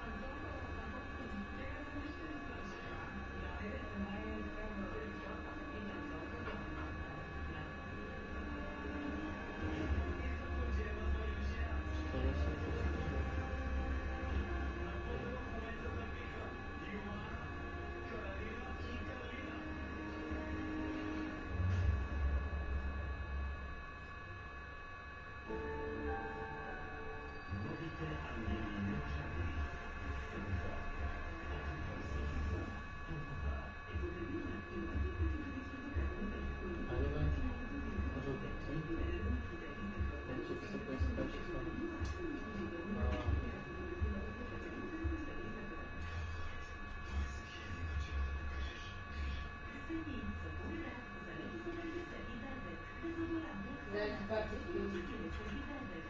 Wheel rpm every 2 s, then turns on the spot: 0, 0, 0, 0, 0, 0, 0, 0, 0, 0, 0, 0, 0, 0, 0, 0, 0, 0, 0, 0, 0, 0, 0, 0, 0, 0, 0, 0.
none